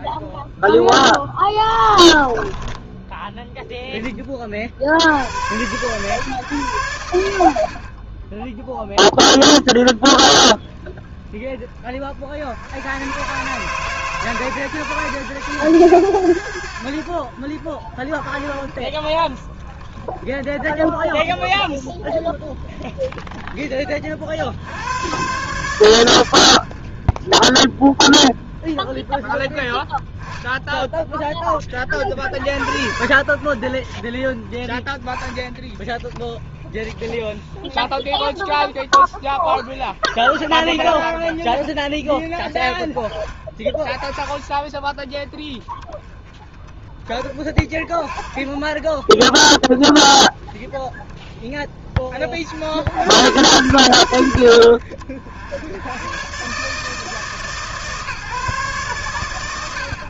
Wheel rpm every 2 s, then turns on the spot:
0, 20, 20, 130, 30, 10, 50, 140, 100, 30, 10, 10, 60, 100, 20, 10, 40, 20, 20, 20, 20, 10, 20, 10, 20, 20, 30, 90, 120, 150.
2-4